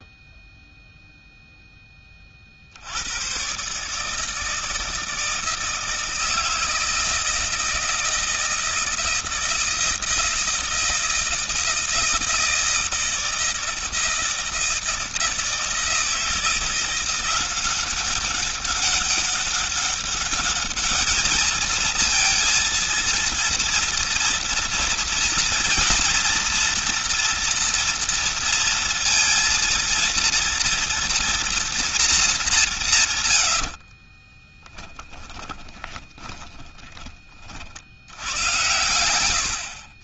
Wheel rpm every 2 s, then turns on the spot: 0, 60, 160, 160, 160, 160, 160, 160, 170, 200, 210, 230, 230, 240, 230, 230, 200, 20, 20, 110.
34-38